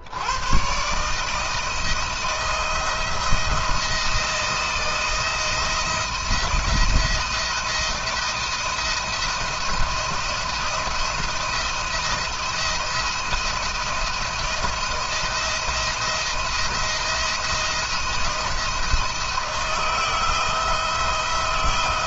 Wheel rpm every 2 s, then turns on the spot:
130, 170, 170, 170, 170, 170, 170, 170, 170, 170, 160.
none